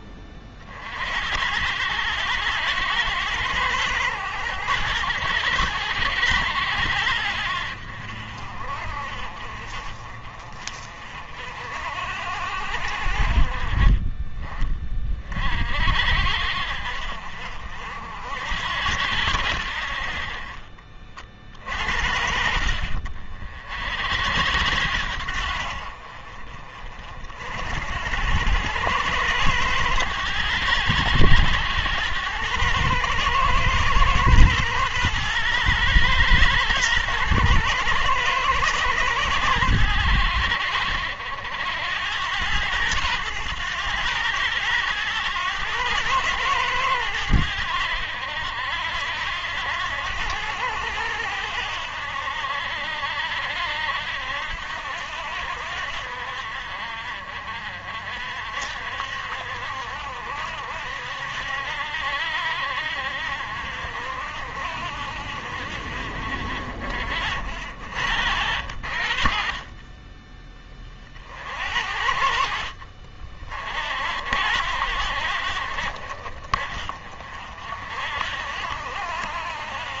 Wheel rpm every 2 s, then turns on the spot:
50, 100, 90, 80, 50, 40, 60, 40, 60, 80, 30, 50, 80, 50, 100, 90, 110, 110, 110, 110, 70, 100, 110, 100, 70, 80, 70, 70, 50, 60, 70, 60, 60, 50, 60, 30, 60, 80, 40, 70.
none